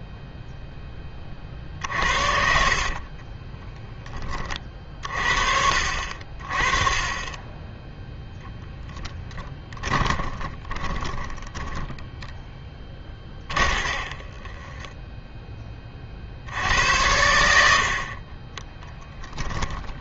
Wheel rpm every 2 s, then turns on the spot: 0, 50, 40, 30, 0, 30, 10, 20, 80, 30.
2-4 10-16 18-20